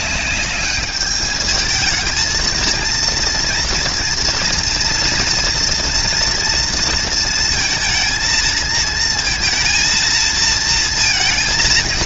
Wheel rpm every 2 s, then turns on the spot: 210, 230, 230, 230, 230, 230.
none